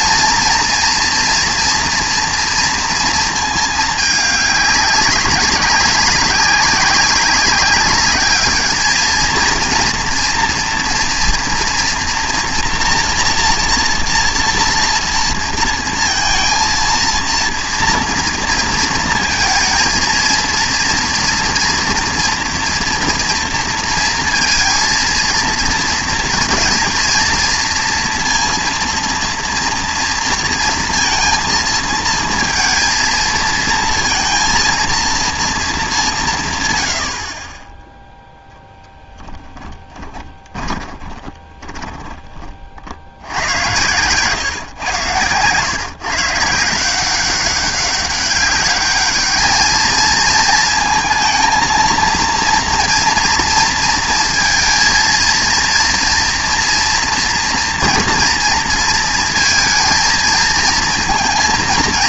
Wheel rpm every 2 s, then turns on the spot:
230, 230, 200, 190, 210, 230, 230, 230, 230, 230, 230, 240, 230, 230, 230, 230, 230, 230, 140, 0, 20, 30, 140, 150, 200, 230, 230, 230, 230, 230, 220.
40-42